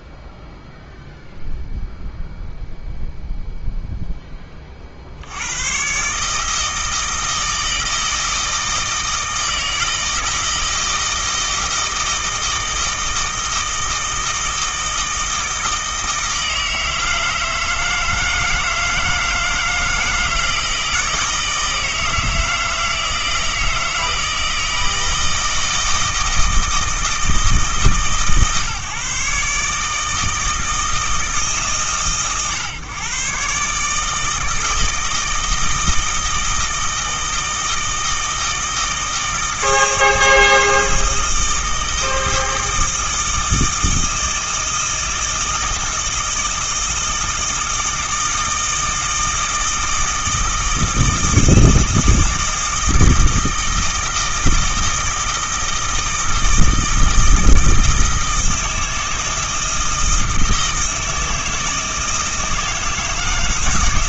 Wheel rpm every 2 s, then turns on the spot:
0, 0, 40, 160, 160, 160, 160, 160, 160, 160, 160, 160, 160, 160, 140, 160, 120, 160, 160, 160, 160, 160, 160, 160, 160, 160, 160, 160, 160, 160, 160, 160.
none